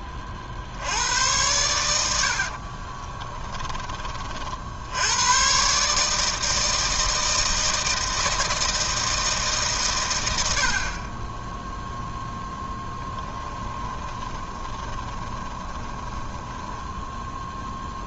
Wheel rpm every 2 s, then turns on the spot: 50, 60, 50, 160, 160, 80, 0, 20, 10.
2-4 14-18